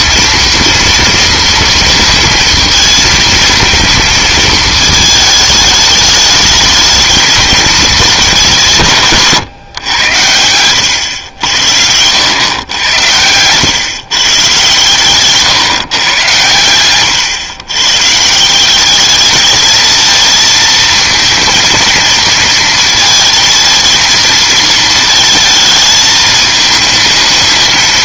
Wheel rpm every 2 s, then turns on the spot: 230, 230, 220, 210, 170, 100, 100, 130, 100, 180, 220, 220, 220, 220.
none